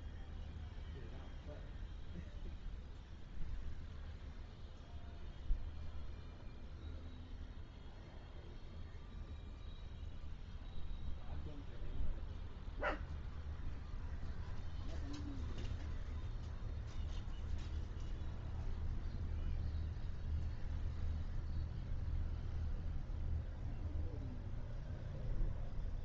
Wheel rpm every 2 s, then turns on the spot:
0, 0, 0, 0, 0, 0, 0, 0, 0, 0, 0, 0, 0.
none